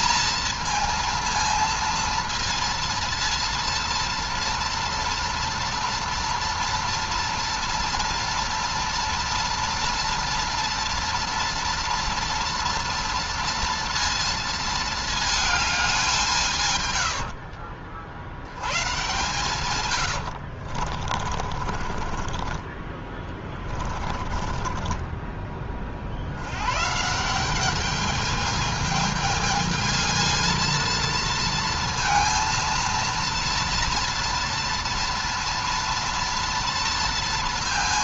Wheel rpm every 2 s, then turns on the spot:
220, 230, 230, 230, 230, 230, 230, 220, 120, 110, 70, 30, 30, 120, 220, 230, 230, 230, 230.
20-26